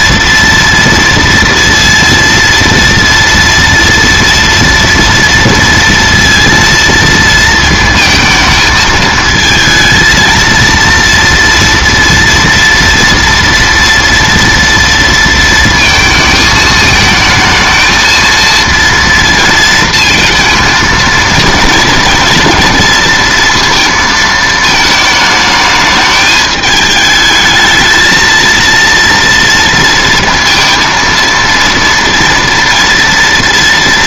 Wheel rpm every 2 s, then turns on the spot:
230, 230, 230, 230, 220, 230, 230, 230, 220, 230, 230, 230, 220, 210, 230, 230, 230.
none